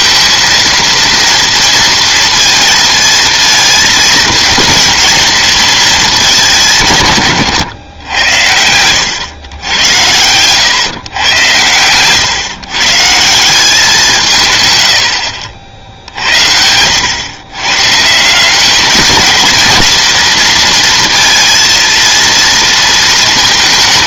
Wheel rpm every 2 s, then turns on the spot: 230, 230, 230, 150, 90, 120, 140, 110, 90, 190, 230, 230.
14-16